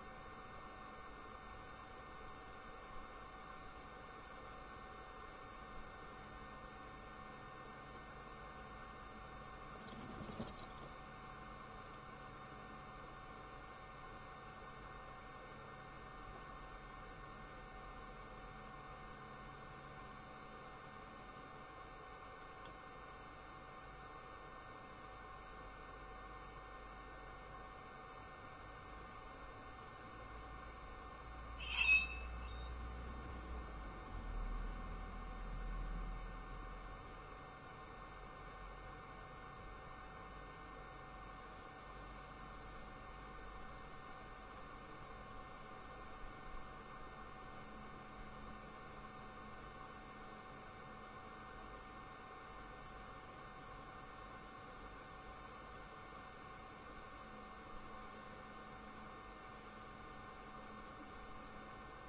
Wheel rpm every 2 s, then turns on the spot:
0, 0, 0, 0, 0, 0, 0, 0, 0, 0, 0, 0, 0, 0, 0, 0, 0, 0, 0, 0, 0, 0, 0, 0, 0, 0, 0, 0, 0, 0, 0.
none